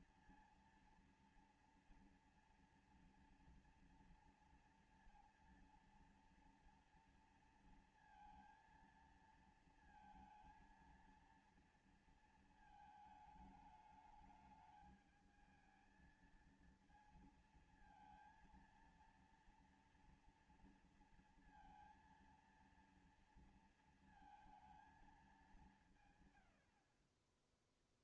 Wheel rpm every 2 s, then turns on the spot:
230, 230, 230, 230, 230, 230, 220, 210, 230, 230, 230, 230, 230, 80.
none